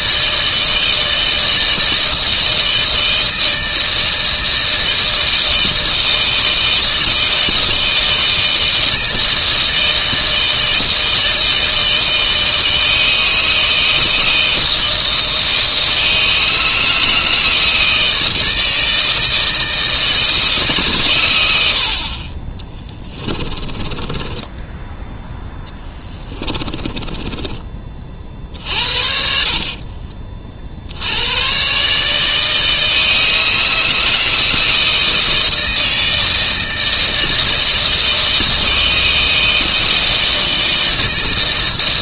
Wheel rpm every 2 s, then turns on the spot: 160, 160, 160, 160, 160, 160, 160, 160, 160, 160, 150, 20, 10, 20, 50, 50, 160, 160, 160, 160, 160.
22-28